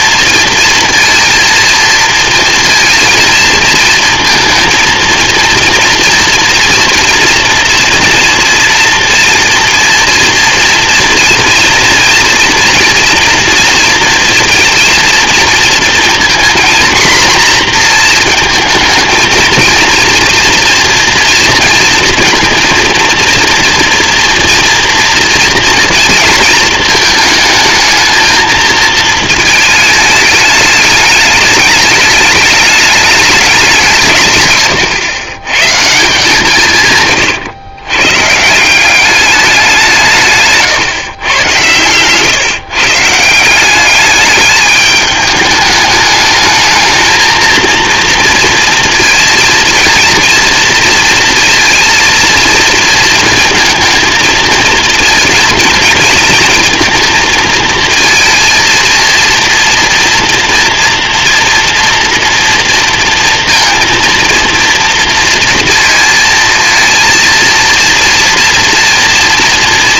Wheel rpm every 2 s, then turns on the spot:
230, 230, 230, 240, 230, 230, 240, 230, 240, 230, 240, 230, 230, 220, 230, 210, 210, 130, 150, 180, 140, 140, 210, 220, 230, 230, 230, 230, 230, 230, 240, 230, 230, 220, 230.
none